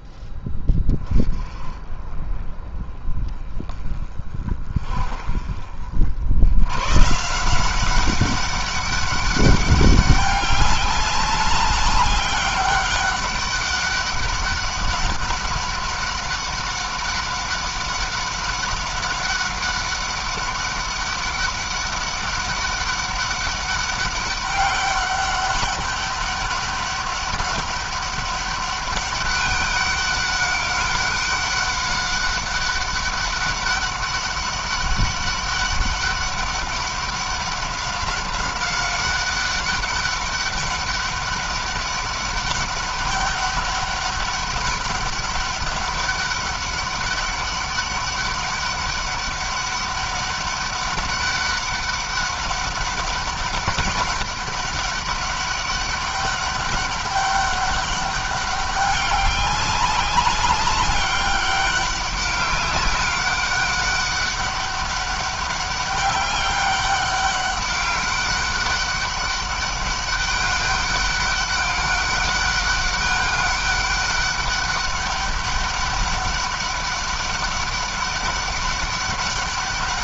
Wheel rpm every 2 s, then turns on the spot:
20, 20, 30, 120, 200, 200, 200, 200, 200, 200, 200, 200, 200, 200, 200, 200, 200, 200, 190, 190, 200, 200, 200, 200, 200, 200, 200, 200, 200, 200, 200, 200, 200, 200, 190, 200, 200, 200, 200, 200.
none